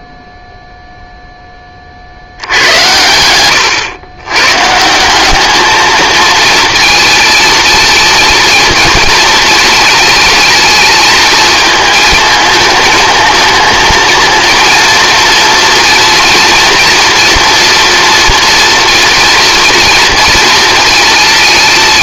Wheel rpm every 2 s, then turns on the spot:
0, 90, 160, 220, 230, 220, 220, 230, 230, 230, 230.
none